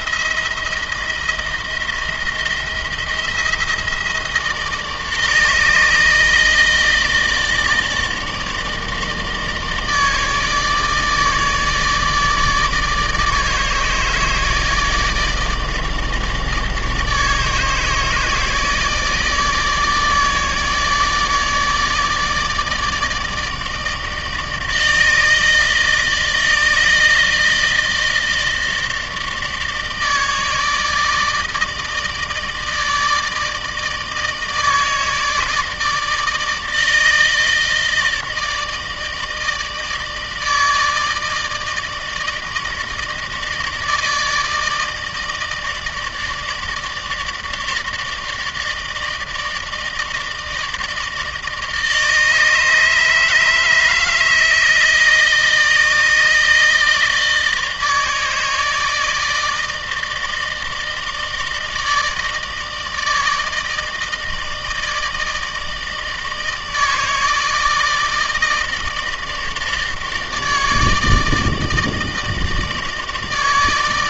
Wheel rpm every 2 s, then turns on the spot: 160, 170, 160, 160, 160, 150, 150, 150, 150, 160, 160, 150, 160, 160, 160, 160, 160, 160, 160, 160, 160, 160, 160, 160, 160, 160, 150, 160, 160, 160, 160, 160, 160, 160, 160, 160, 160.
none